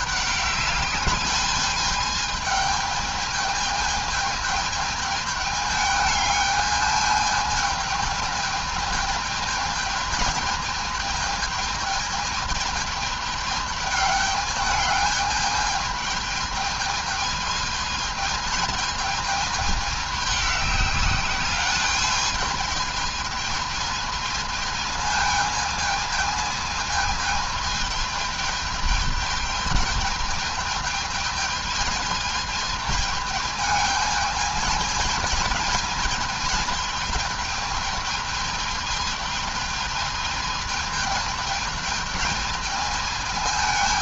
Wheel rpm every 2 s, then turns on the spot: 210, 210, 210, 210, 220, 220, 210, 210, 210, 220, 200, 210, 220, 220, 220, 220, 220, 220, 220, 220, 220, 220.
none